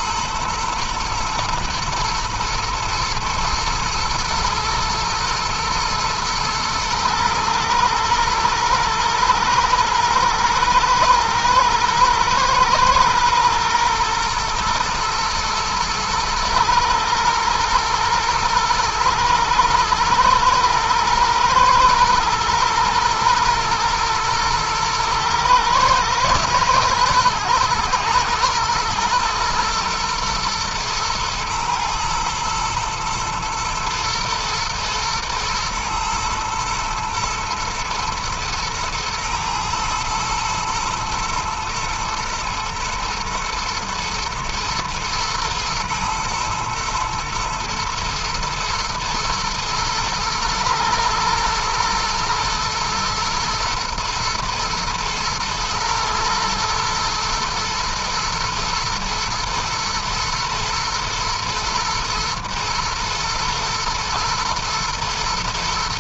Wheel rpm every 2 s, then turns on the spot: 110, 120, 110, 110, 110, 120, 120, 120, 110, 110, 110, 110, 110, 110, 120, 110, 110, 110, 110, 110, 120, 120, 110, 110, 110, 110, 110, 110, 120, 120, 120, 110, 110.
none